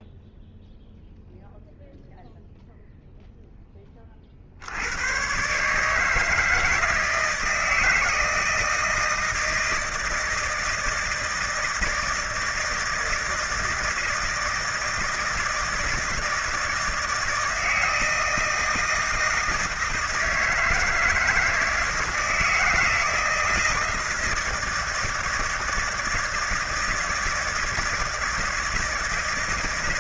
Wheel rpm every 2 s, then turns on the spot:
0, 0, 70, 160, 160, 160, 160, 160, 160, 160, 160, 160, 160, 160, 160.
none